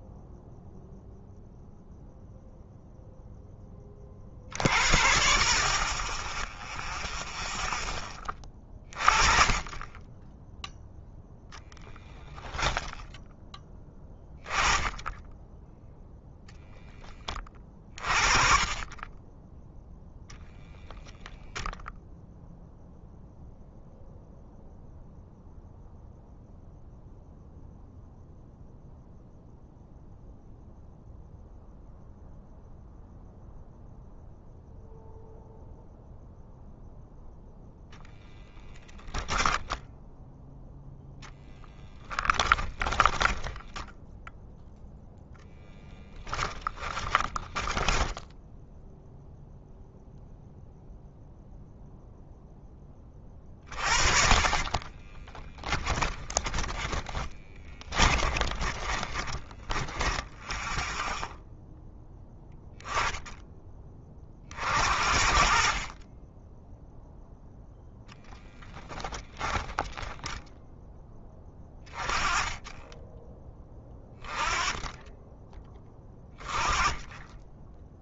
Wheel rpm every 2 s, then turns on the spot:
0, 0, 60, 0, 20, 0, 0, 20, 0, 20, 0, 0, 0, 0, 0, 0, 0, 0, 0, 0, 0, 10, 0, 10, 0, 0, 10, 30, 20, 20, 0, 10, 40, 10, 10, 10, 20, 20, 20.
42-44 46-48 54-60 68-70